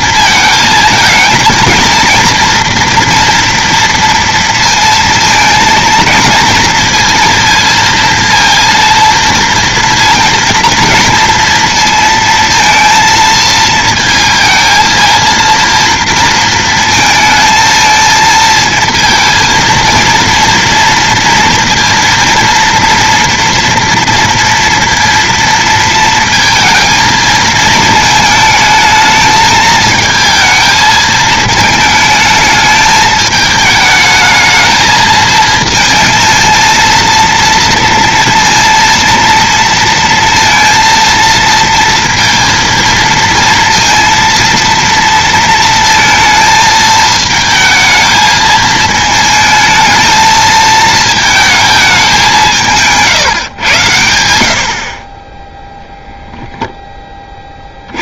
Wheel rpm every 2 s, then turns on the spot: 220, 230, 230, 230, 230, 230, 230, 220, 230, 230, 230, 230, 230, 230, 220, 220, 220, 220, 230, 230, 230, 230, 230, 220, 220, 220, 160, 70, 10.
none